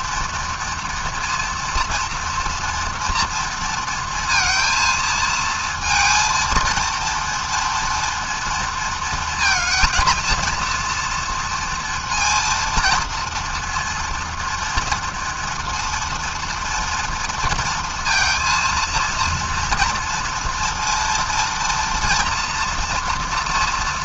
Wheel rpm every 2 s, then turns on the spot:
230, 230, 220, 230, 230, 230, 230, 230, 230, 230, 230, 230.
none